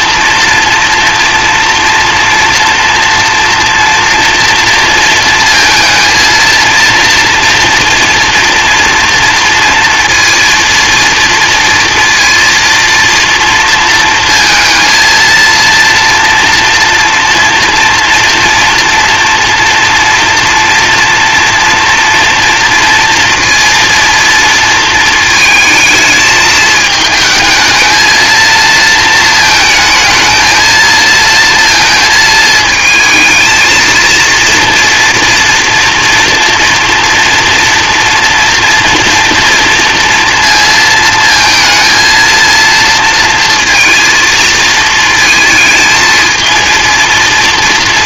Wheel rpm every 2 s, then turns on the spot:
230, 230, 230, 230, 230, 230, 230, 230, 230, 230, 240, 230, 230, 220, 220, 220, 230, 230, 230, 230, 220, 230, 230, 230.
none